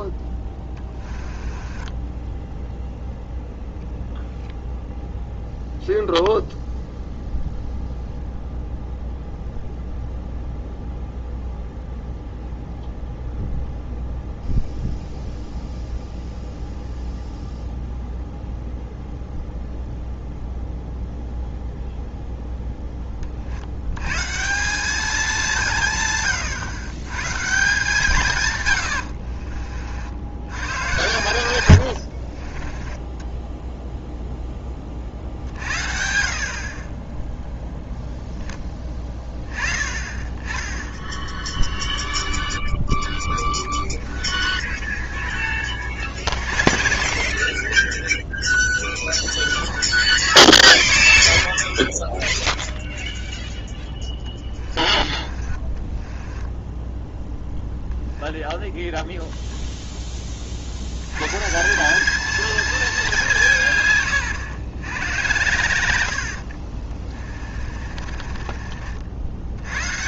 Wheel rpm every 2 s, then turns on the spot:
10, 0, 0, 0, 0, 0, 0, 0, 0, 0, 0, 10, 190, 110, 100, 90, 20, 20, 40, 10, 20, 10, 40, 40, 20, 30, 10, 30, 10, 0, 70, 220, 100, 40, 40.
0-2 28-30 32-34 44-58 66-68